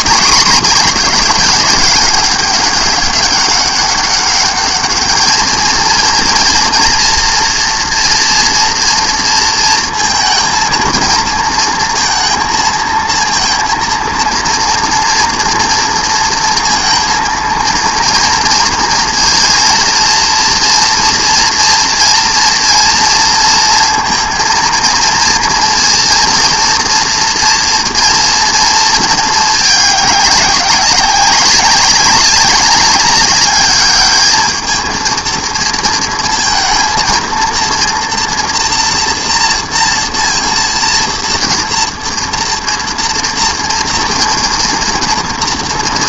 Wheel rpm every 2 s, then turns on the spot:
200, 200, 210, 230, 230, 230, 230, 230, 230, 230, 230, 230, 230, 230, 230, 190, 200, 220, 230, 240, 230, 230, 230.
none